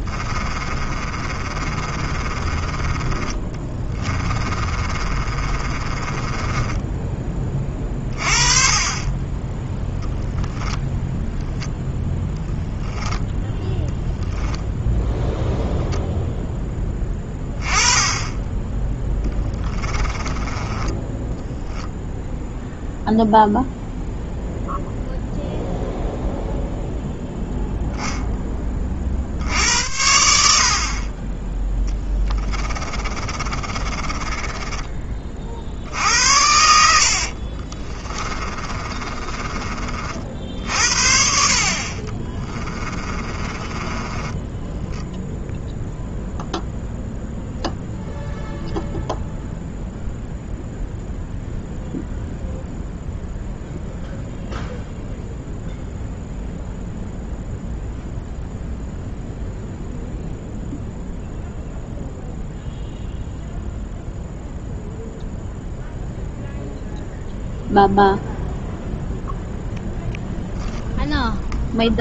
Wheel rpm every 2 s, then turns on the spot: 30, 10, 40, 20, 30, 10, 0, 10, 10, 10, 20, 0, 0, 0, 20, 60, 20, 20, 70, 40, 60, 30, 10, 0, 0, 0, 0, 0, 0, 0, 0, 0, 0, 0, 0, 0.
0-8 20-22 32-40 42-46